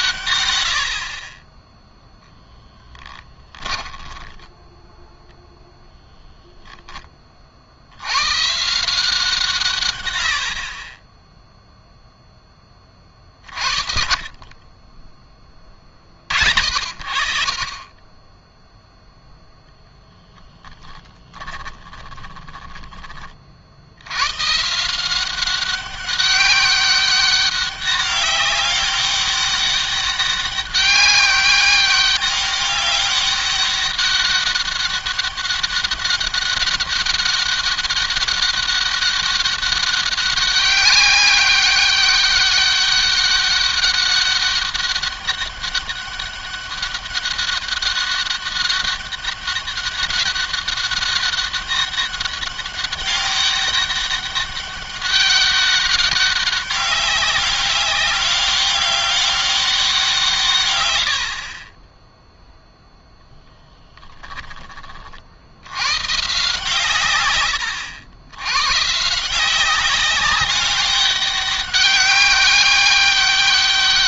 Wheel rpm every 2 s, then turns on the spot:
100, 10, 10, 10, 140, 40, 20, 20, 60, 10, 10, 20, 150, 200, 200, 200, 200, 200, 200, 200, 200, 200, 200, 200, 200, 190, 200, 200, 200, 200, 120, 0, 20, 140, 130, 200, 200.
2-4 60-62